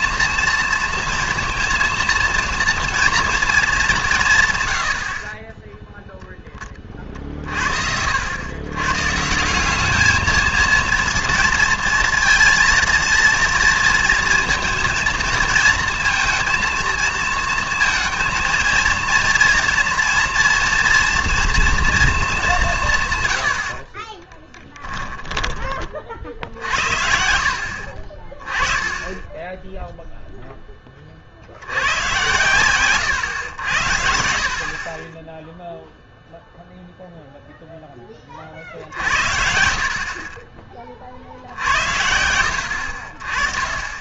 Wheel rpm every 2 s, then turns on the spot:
230, 230, 120, 20, 110, 220, 230, 230, 230, 230, 230, 190, 10, 60, 30, 10, 110, 50, 0, 50, 30, 80.
24-26